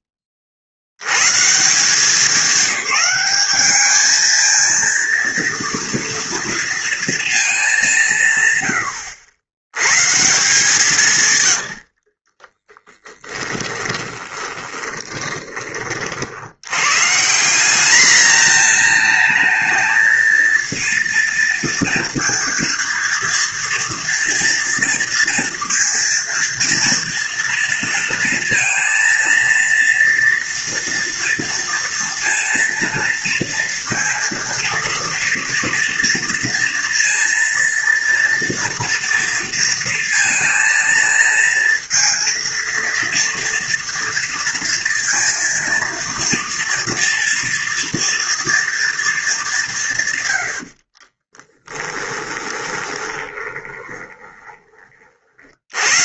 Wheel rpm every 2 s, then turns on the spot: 70, 200, 230, 230, 90, 140, 10, 20, 140, 220, 230, 230, 230, 230, 230, 230, 230, 230, 230, 230, 230, 230, 230, 230, 220, 40, 20, 50.
12-16 50-54